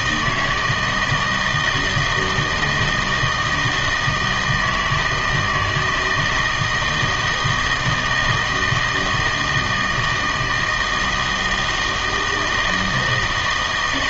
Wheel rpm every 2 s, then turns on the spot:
160, 160, 160, 170, 160, 160, 160.
none